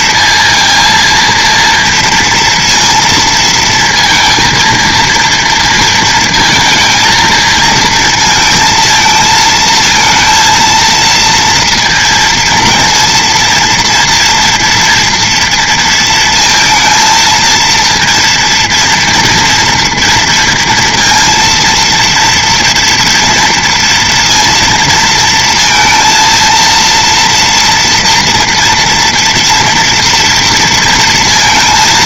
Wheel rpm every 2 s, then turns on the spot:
230, 230, 230, 220, 230, 230, 230, 230, 230, 230, 230, 230, 230, 230, 240, 230.
none